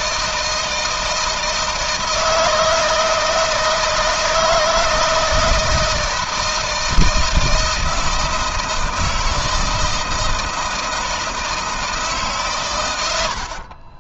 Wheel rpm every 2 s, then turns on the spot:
160, 160, 160, 160, 160, 160, 130.
none